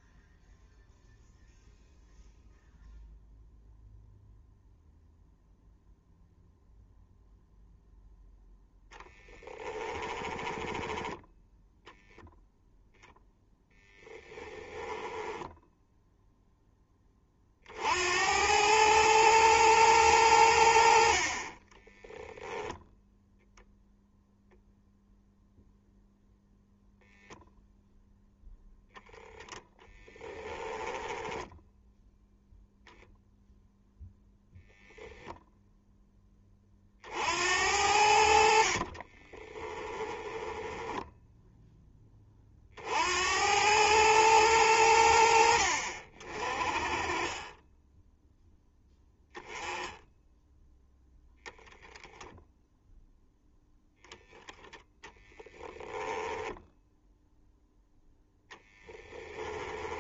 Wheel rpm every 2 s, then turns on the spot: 0, 0, 0, 0, 10, 10, 10, 10, 10, 110, 70, 0, 0, 0, 0, 10, 0, 0, 40, 40, 10, 60, 90, 30, 0, 0, 0, 10, 0, 10.
8-12 14-16 30-32 40-42 54-56 58-60